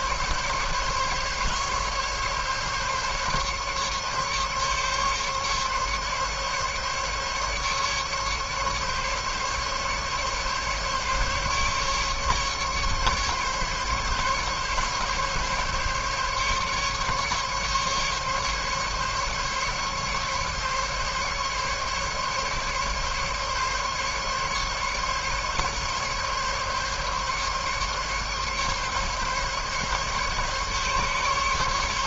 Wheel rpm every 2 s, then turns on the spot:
140, 140, 140, 140, 140, 140, 150, 140, 140, 140, 140, 140, 140, 140, 140, 140.
none